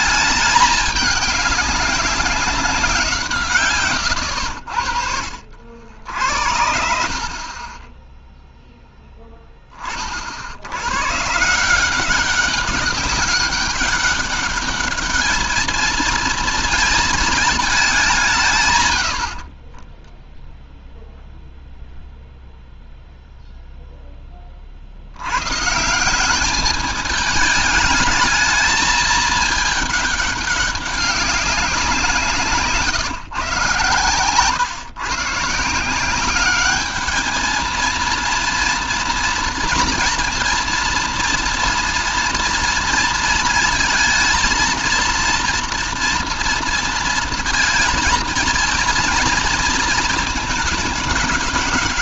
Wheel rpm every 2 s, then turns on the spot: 210, 190, 80, 70, 10, 70, 200, 200, 220, 150, 0, 0, 40, 200, 210, 200, 160, 120, 200, 230, 230, 230, 230, 230, 230, 220.
32-34